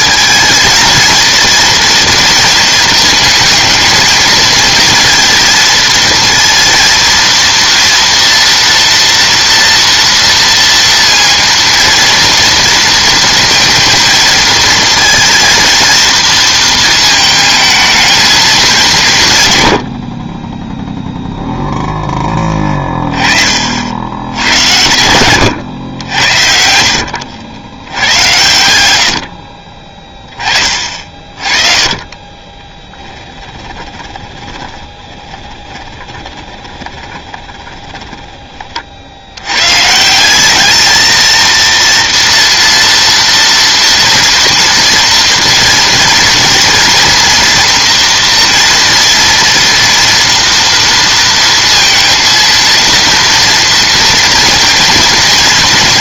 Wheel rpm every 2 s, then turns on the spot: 230, 220, 230, 230, 230, 230, 230, 230, 220, 140, 0, 50, 100, 70, 60, 30, 10, 20, 20, 30, 200, 230, 230, 230, 230, 230, 230, 230.
24-26 30-38